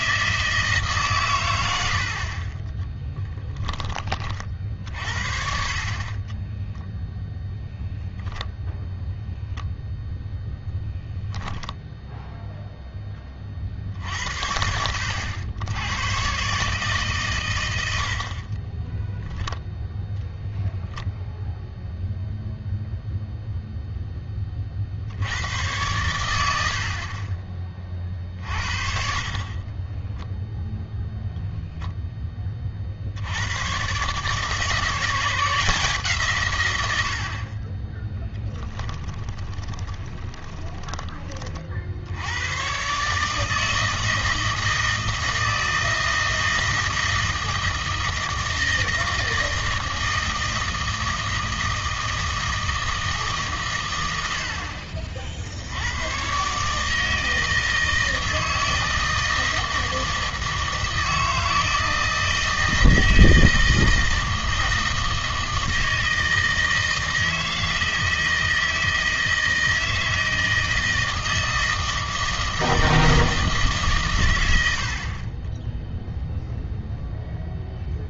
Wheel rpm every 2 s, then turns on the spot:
160, 20, 50, 20, 0, 0, 0, 70, 140, 20, 0, 0, 30, 80, 50, 0, 30, 160, 120, 10, 20, 110, 160, 160, 160, 160, 160, 60, 150, 160, 160, 160, 160, 160, 160, 160, 160, 80, 0.
6-8 18-20 38-42